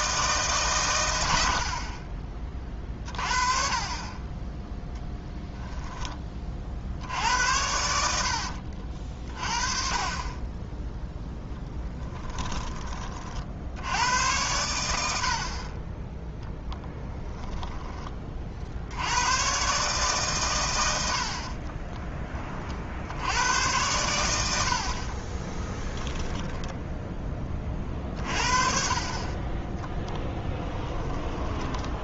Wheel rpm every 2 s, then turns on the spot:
120, 30, 10, 50, 60, 20, 20, 90, 10, 50, 110, 60, 60, 10, 40, 10.
8-10 30-32